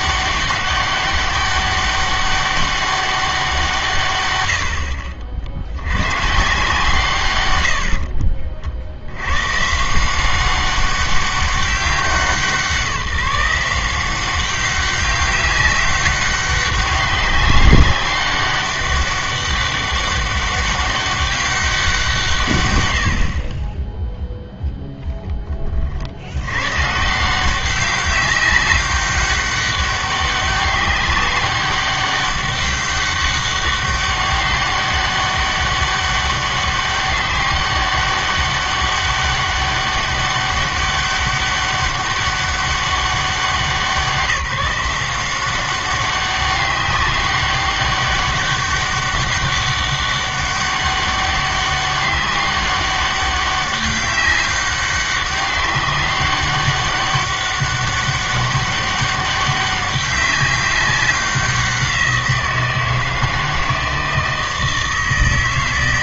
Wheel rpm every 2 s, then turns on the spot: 200, 200, 80, 160, 50, 190, 180, 190, 200, 200, 200, 120, 0, 100, 200, 200, 200, 200, 200, 200, 200, 200, 170, 200, 200, 200, 190, 200, 200, 200, 200, 170, 160.
none